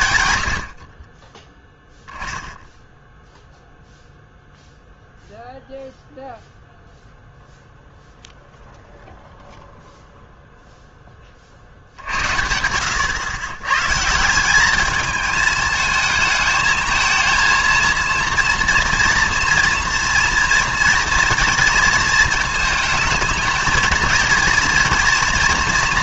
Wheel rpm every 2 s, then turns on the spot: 70, 0, 0, 0, 0, 0, 80, 200, 220, 230, 230, 220, 230.
none